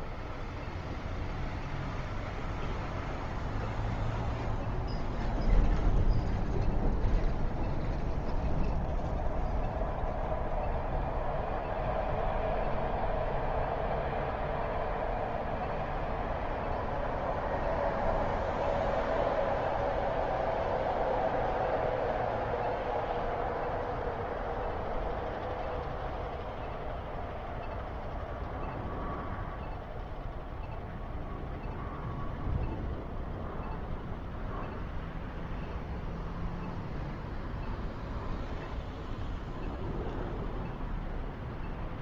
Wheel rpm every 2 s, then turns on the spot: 0, 0, 0, 0, 0, 0, 0, 0, 0, 0, 0, 0, 0, 0, 0, 0, 0, 0, 0, 0, 0.
none